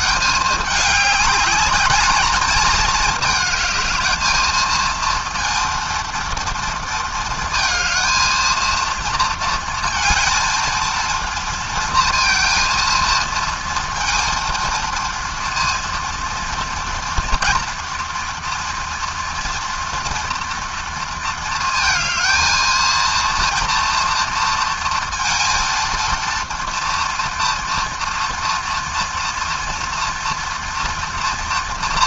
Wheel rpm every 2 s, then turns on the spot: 210, 220, 220, 230, 230, 230, 230, 230, 230, 230, 230, 230, 230, 230, 240, 230.
none